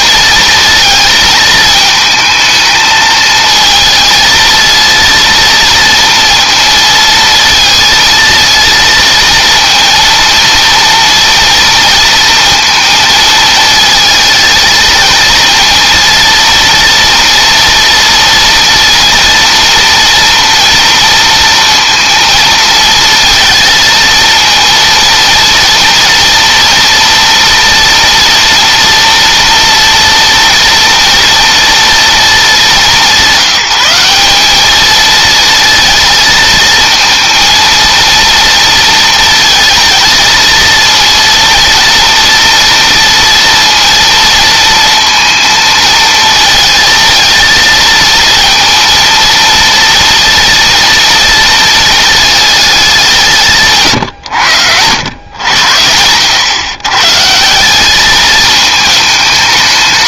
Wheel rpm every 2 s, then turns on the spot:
230, 220, 230, 230, 230, 230, 220, 230, 230, 230, 230, 230, 230, 230, 230, 230, 200, 220, 220, 230, 230, 230, 230, 230, 230, 230, 190, 100, 140, 220.
none